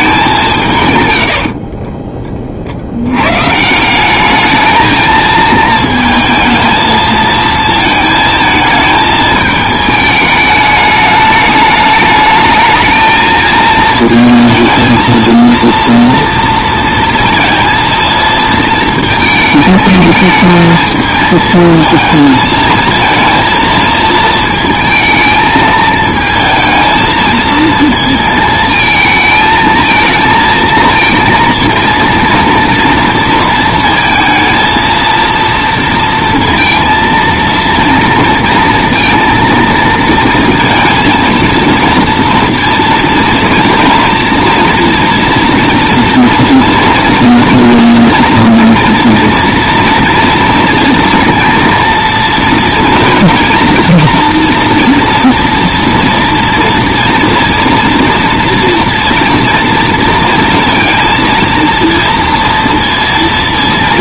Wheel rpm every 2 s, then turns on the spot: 170, 40, 210, 220, 220, 210, 210, 220, 230, 220, 220, 220, 220, 220, 220, 230, 230, 230, 230, 230, 230, 230, 230, 230, 230, 230, 230, 230, 230, 230, 230, 230.
none